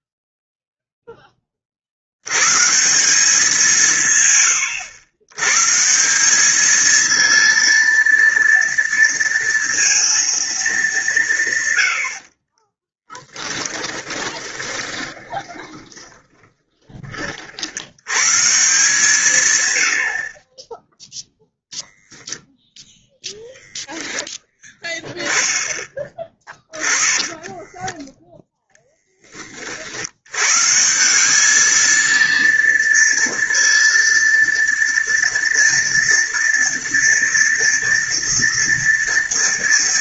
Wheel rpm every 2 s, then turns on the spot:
10, 170, 100, 230, 230, 170, 10, 20, 50, 130, 0, 0, 10, 10, 30, 210, 230, 230, 230, 230.
12-16 26-28